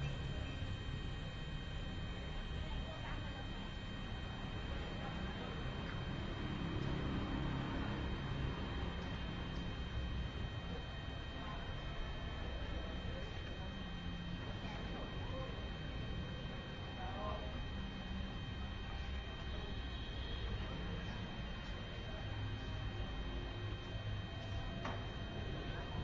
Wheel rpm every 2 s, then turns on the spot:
0, 0, 0, 0, 0, 0, 0, 0, 0, 0, 0, 0, 0.
none